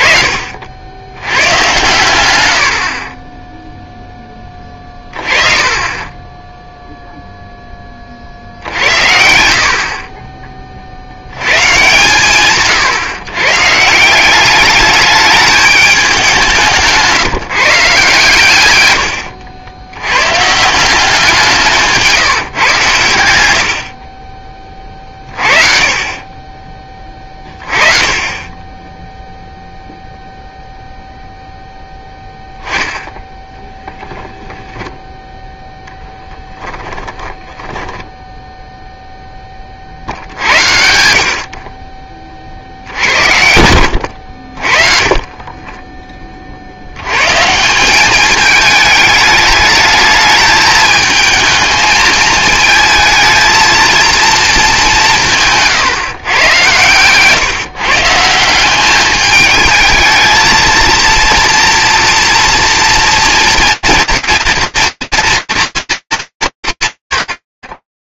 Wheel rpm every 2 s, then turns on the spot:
80, 30, 30, 0, 80, 30, 150, 210, 180, 120, 190, 130, 40, 20, 10, 0, 0, 10, 20, 10, 60, 60, 30, 80, 210, 220, 220, 200, 130, 190, 230, 240, 230, 150.
36-38